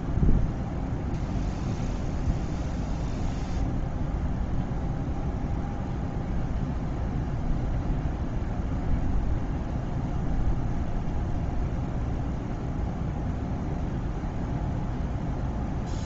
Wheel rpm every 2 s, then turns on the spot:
0, 0, 0, 0, 0, 0, 0, 0.
none